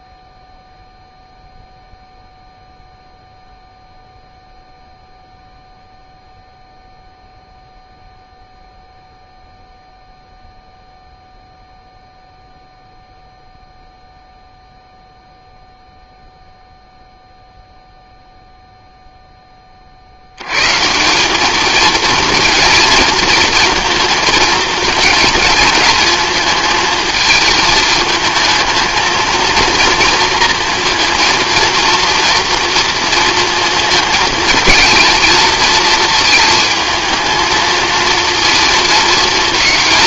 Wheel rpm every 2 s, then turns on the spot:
0, 0, 0, 0, 0, 0, 0, 0, 0, 0, 130, 230, 220, 220, 220, 230, 230, 220, 220, 230.
none